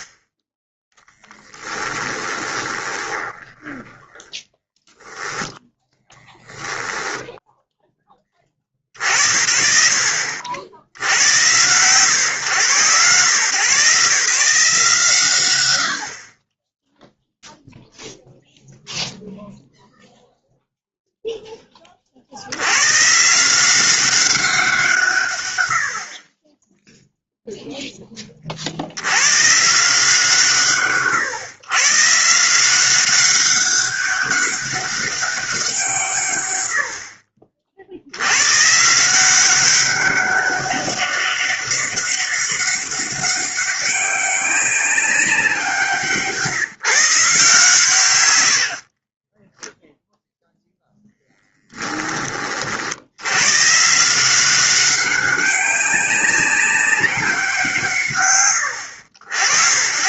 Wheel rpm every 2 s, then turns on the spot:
10, 20, 0, 10, 60, 110, 120, 160, 0, 0, 0, 110, 170, 10, 80, 120, 180, 200, 70, 150, 200, 200, 200, 170, 30, 0, 60, 190, 190, 70.
2-4